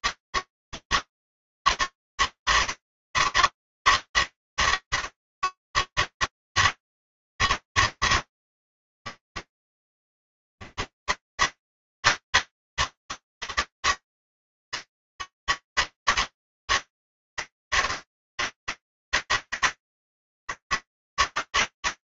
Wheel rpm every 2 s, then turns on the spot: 150, 160, 150, 160, 160, 160, 160, 160, 160, 160, 150.
none